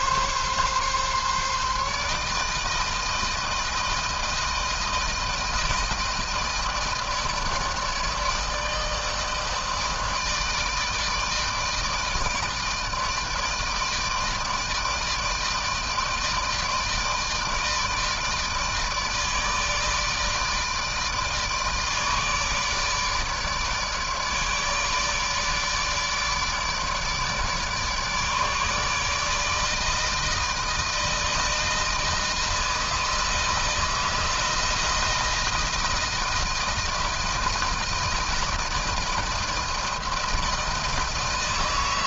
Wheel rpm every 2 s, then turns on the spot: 140, 160, 160, 160, 160, 160, 160, 160, 160, 160, 160, 160, 150, 150, 150, 160, 160, 160, 160, 160, 160.
none